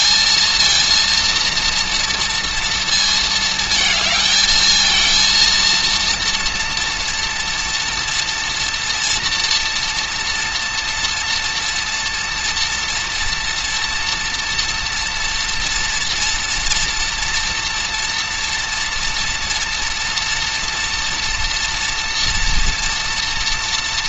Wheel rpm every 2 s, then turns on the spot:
230, 230, 220, 230, 230, 230, 230, 240, 230, 230, 230, 230.
none